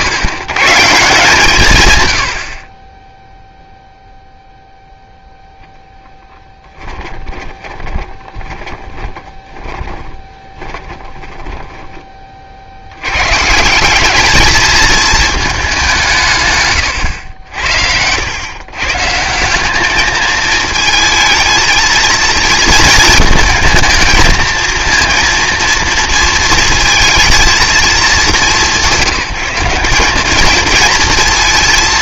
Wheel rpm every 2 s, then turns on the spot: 100, 50, 0, 10, 20, 20, 60, 220, 120, 130, 220, 230, 230, 230, 190, 220.
6-12